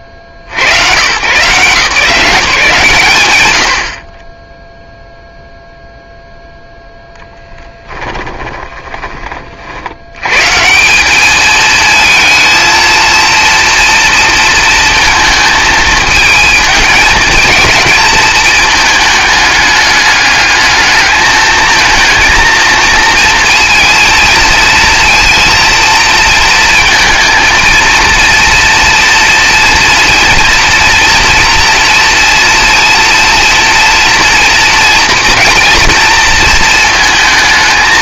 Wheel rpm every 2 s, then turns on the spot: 70, 160, 0, 0, 20, 170, 220, 230, 220, 220, 210, 230, 230, 230, 230, 230, 230, 240, 230.
8-10